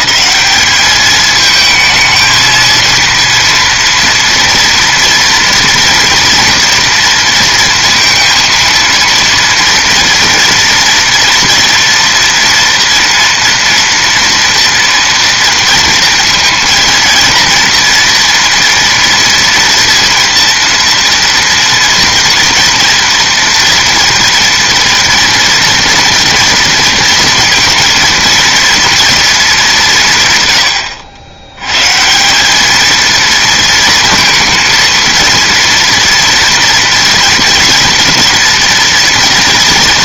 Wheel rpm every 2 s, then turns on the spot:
210, 230, 230, 230, 230, 230, 230, 240, 230, 230, 230, 230, 230, 230, 230, 110, 220, 230, 230, 230.
none